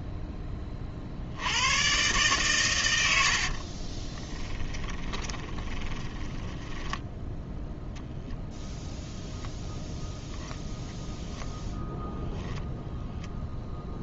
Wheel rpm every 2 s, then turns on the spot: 20, 120, 10, 10, 10, 0, 0.
4-8